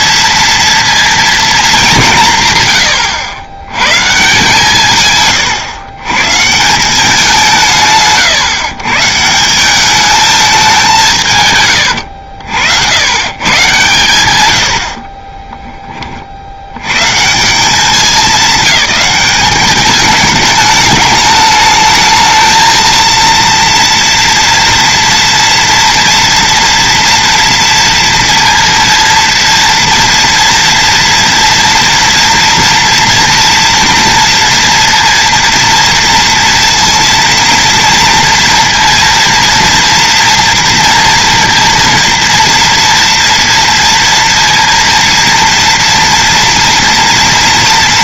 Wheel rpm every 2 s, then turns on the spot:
230, 120, 150, 170, 130, 190, 70, 80, 100, 210, 210, 230, 240, 230, 230, 230, 240, 230, 230, 230, 230, 230, 230, 230.
none